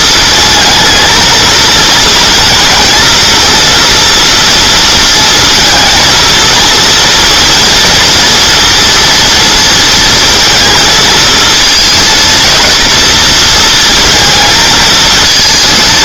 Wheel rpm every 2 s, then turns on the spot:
220, 230, 230, 230, 230, 220, 230, 220.
none